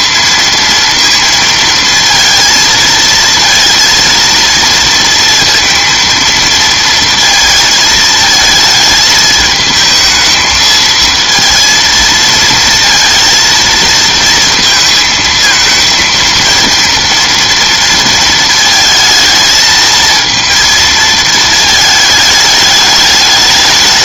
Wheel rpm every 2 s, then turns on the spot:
230, 230, 230, 230, 220, 220, 230, 220, 230, 220, 230, 210.
none